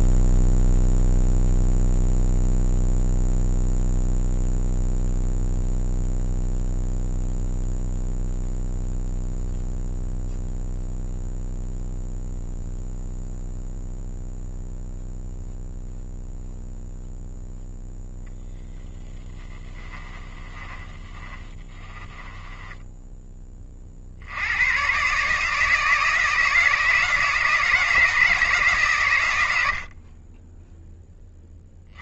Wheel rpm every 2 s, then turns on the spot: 0, 0, 0, 0, 0, 0, 0, 0, 0, 0, 20, 10, 110, 160, 150, 10.
20-24